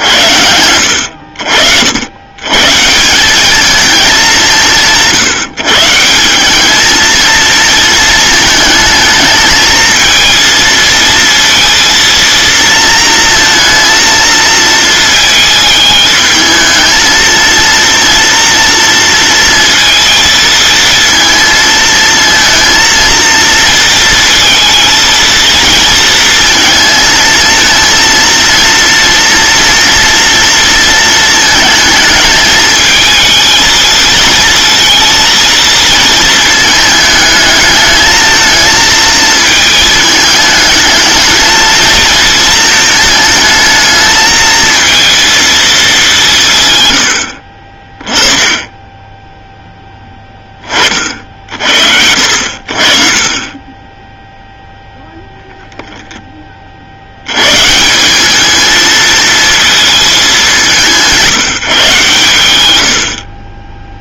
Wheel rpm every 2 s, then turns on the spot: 80, 150, 180, 210, 220, 230, 230, 230, 220, 230, 230, 230, 230, 230, 230, 230, 220, 230, 220, 220, 220, 220, 220, 120, 20, 30, 40, 0, 50, 220, 190, 90.
none